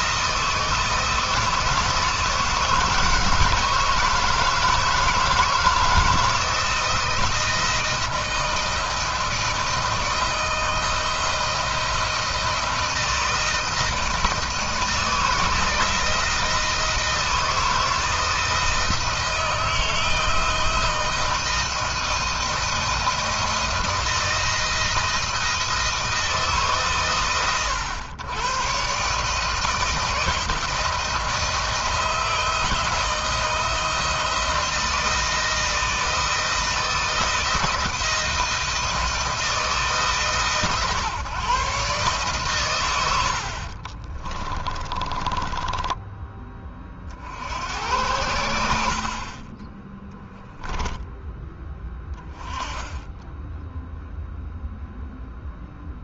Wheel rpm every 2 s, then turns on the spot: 160, 160, 160, 160, 170, 160, 160, 160, 160, 160, 160, 170, 170, 140, 140, 170, 170, 160, 160, 160, 150, 120, 30, 30, 50, 0, 10, 0.
44-46